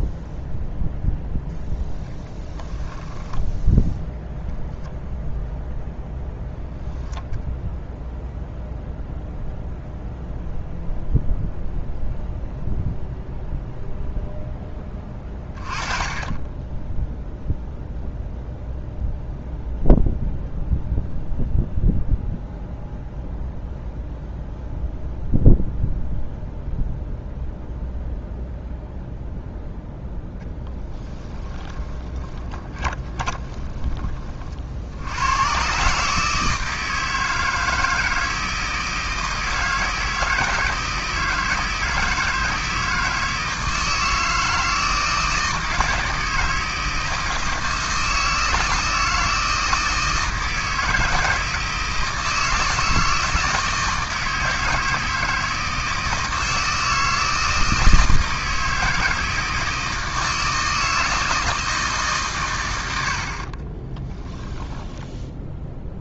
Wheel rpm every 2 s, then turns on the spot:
0, 10, 0, 10, 0, 0, 0, 10, 10, 0, 0, 0, 0, 0, 0, 10, 10, 60, 160, 160, 160, 160, 160, 160, 160, 160, 160, 160, 160, 160, 160, 100, 10.
30-34